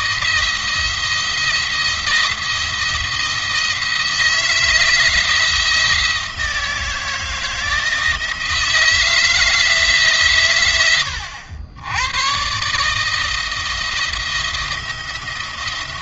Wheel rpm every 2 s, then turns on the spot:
170, 170, 160, 160, 160, 110, 150, 170.
none